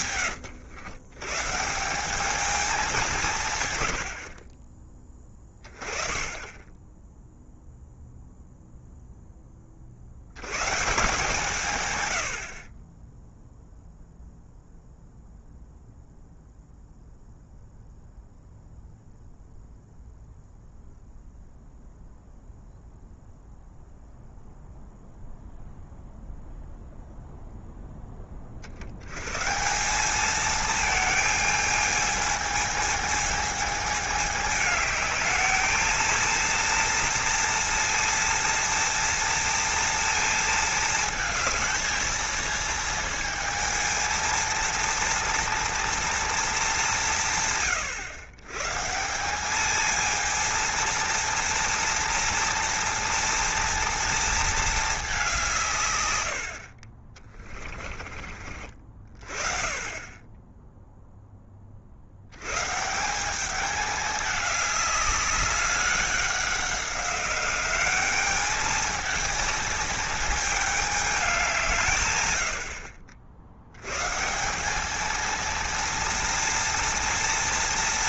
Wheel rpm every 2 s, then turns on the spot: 120, 200, 20, 10, 0, 130, 30, 0, 0, 0, 0, 0, 0, 0, 60, 220, 220, 210, 230, 230, 220, 220, 230, 210, 140, 230, 230, 220, 50, 40, 0, 150, 200, 190, 220, 220, 80, 190, 230.
none